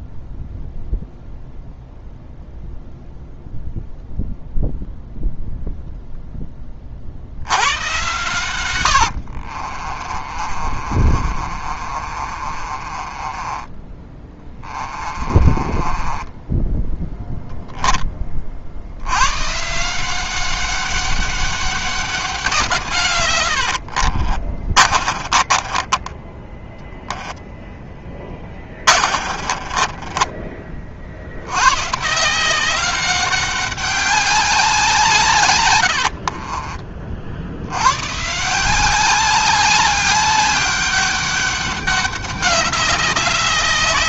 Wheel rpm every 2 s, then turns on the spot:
0, 0, 0, 30, 90, 40, 30, 20, 10, 70, 190, 150, 40, 20, 40, 30, 190, 160, 40, 180, 200, 200.
10-16 24-30